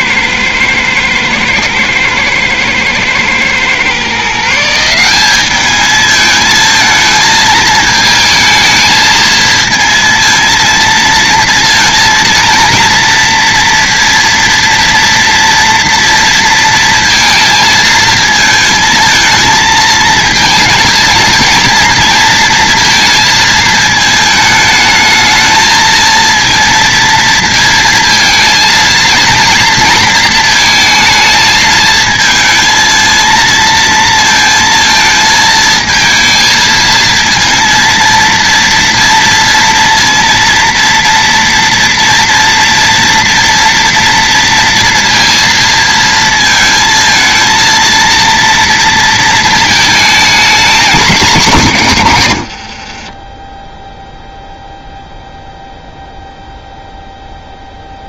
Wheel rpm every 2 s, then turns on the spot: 110, 120, 180, 220, 220, 230, 230, 230, 230, 220, 230, 220, 220, 230, 220, 220, 230, 230, 230, 240, 230, 230, 230, 220, 230, 240, 70, 0, 0.
52-54